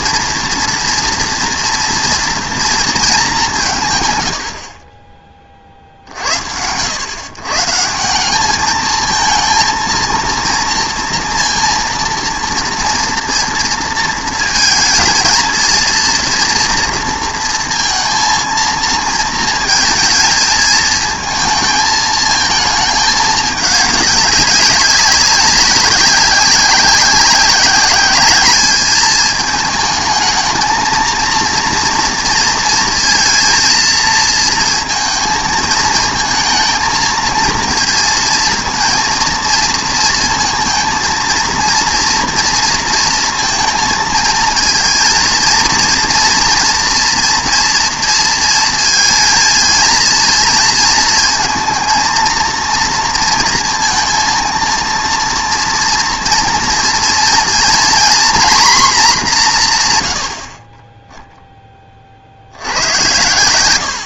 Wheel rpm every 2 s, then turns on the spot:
230, 220, 30, 110, 220, 230, 240, 230, 230, 230, 220, 220, 190, 190, 210, 220, 230, 230, 230, 230, 230, 230, 220, 240, 230, 230, 230, 230, 230, 240, 20, 90.
none